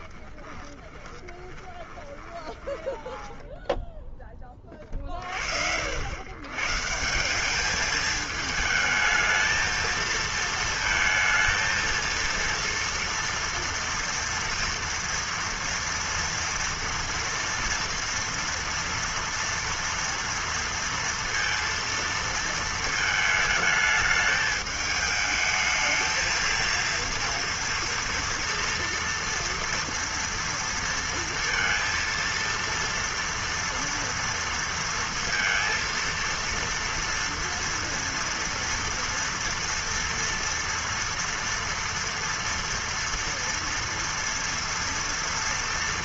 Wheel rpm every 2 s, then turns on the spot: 20, 10, 30, 150, 220, 230, 230, 230, 230, 230, 230, 220, 220, 230, 230, 230, 230, 230, 230, 230, 230, 230, 230.
0-4